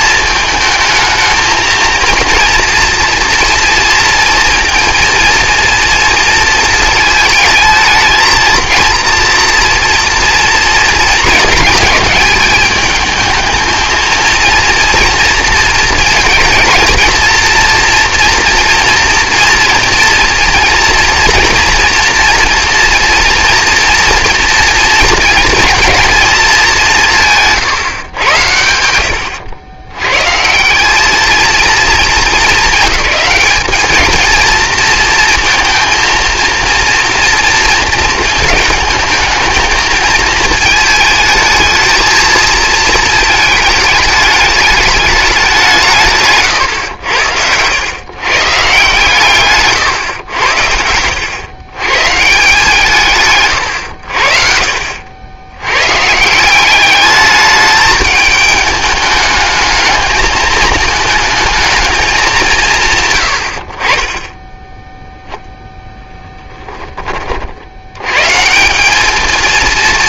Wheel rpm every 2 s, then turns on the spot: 220, 230, 230, 220, 230, 230, 210, 230, 220, 240, 240, 230, 230, 200, 80, 180, 210, 230, 230, 220, 220, 220, 210, 130, 150, 90, 160, 60, 190, 210, 210, 180, 0, 10, 180.
54-56